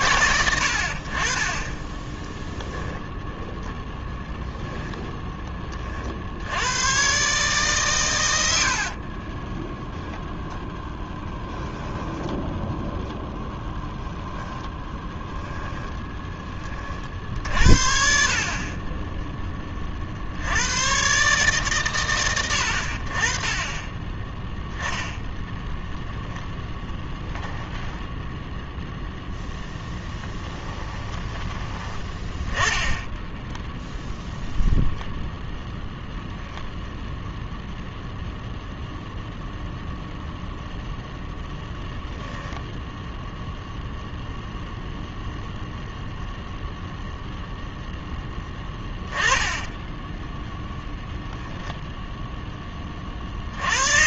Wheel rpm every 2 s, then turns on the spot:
70, 10, 0, 110, 50, 0, 0, 10, 50, 30, 120, 60, 0, 10, 0, 20, 10, 0, 0, 0, 0, 0, 0, 0, 10, 10, 20.
8-10 14-16 30-32 48-54